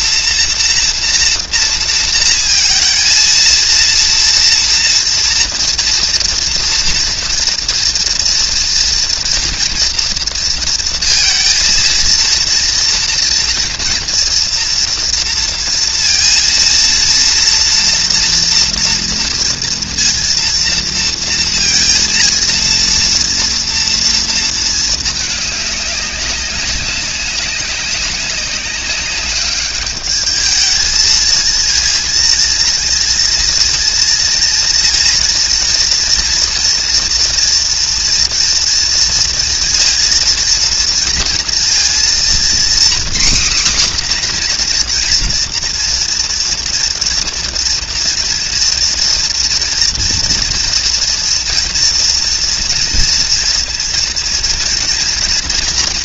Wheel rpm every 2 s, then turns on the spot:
240, 230, 240, 240, 240, 230, 230, 230, 230, 240, 230, 230, 220, 190, 190, 210, 230, 230, 230, 230, 230, 250, 250, 230, 230, 230, 230, 230.
none